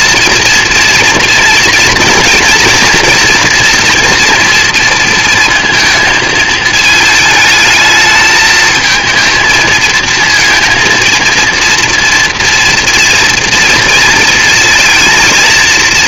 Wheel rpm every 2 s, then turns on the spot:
230, 240, 230, 220, 220, 230, 240, 230.
none